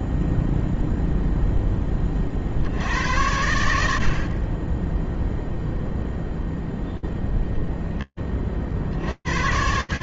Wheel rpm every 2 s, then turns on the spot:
10, 90, 0, 0, 100.
none